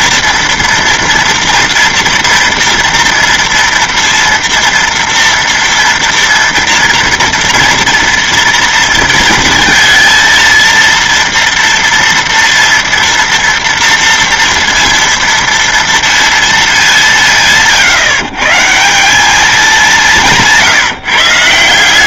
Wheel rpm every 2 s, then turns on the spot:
230, 230, 230, 230, 230, 230, 230, 230, 200, 150, 150.
none